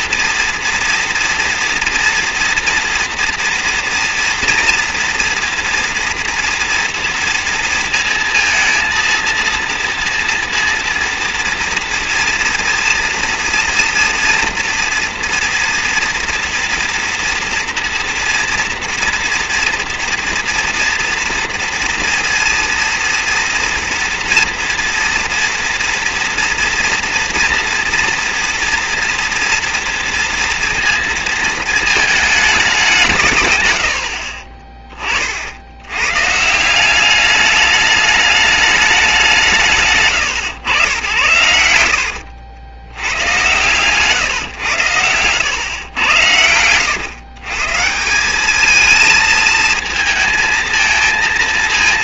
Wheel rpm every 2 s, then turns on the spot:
230, 240, 240, 240, 230, 230, 240, 230, 230, 230, 230, 230, 240, 240, 230, 230, 200, 30, 160, 210, 90, 100, 120, 110, 210, 230.
34-36